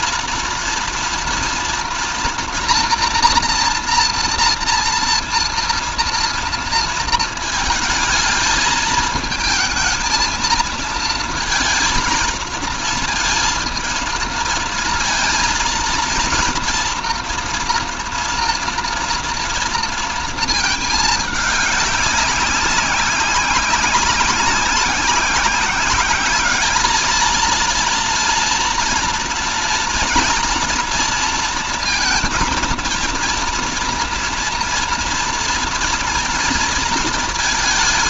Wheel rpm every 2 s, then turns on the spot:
230, 230, 230, 230, 220, 230, 230, 230, 230, 230, 220, 200, 190, 210, 230, 230, 230, 230, 230.
none